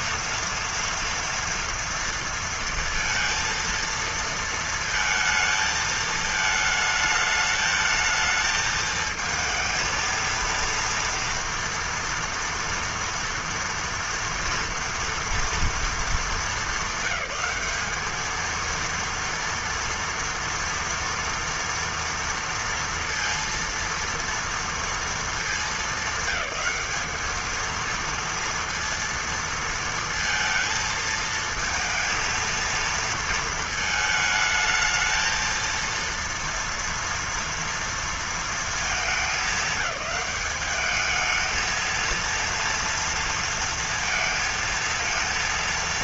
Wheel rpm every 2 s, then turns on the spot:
230, 230, 230, 220, 220, 230, 240, 240, 220, 220, 230, 230, 230, 220, 230, 230, 230, 220, 230, 230, 210, 230, 230.
none